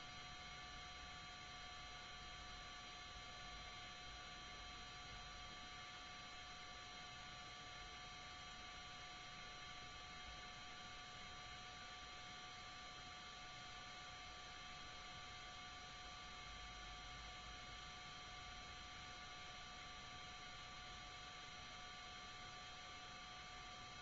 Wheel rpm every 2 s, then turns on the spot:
0, 0, 0, 0, 0, 0, 0, 0, 0, 0, 0, 0.
none